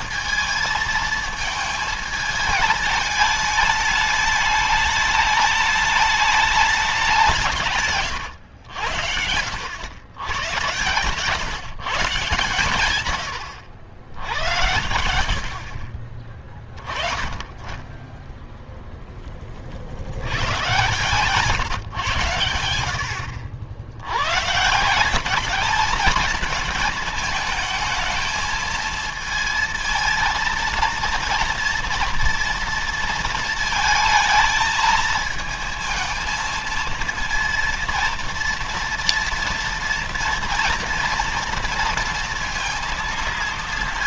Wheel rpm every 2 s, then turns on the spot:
220, 210, 210, 200, 80, 130, 120, 80, 20, 0, 130, 80, 170, 220, 230, 230, 230, 220, 230, 230, 240, 230.
14-16 20-22